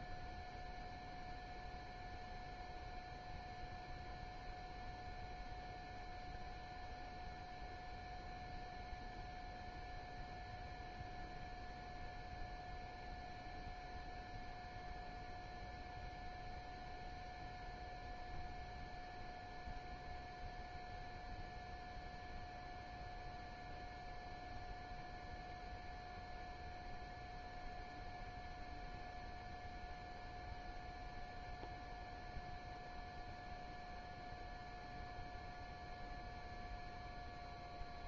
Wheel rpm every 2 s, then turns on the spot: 0, 0, 0, 0, 0, 0, 0, 0, 0, 0, 0, 0, 0, 0, 0, 0, 0, 0, 0.
none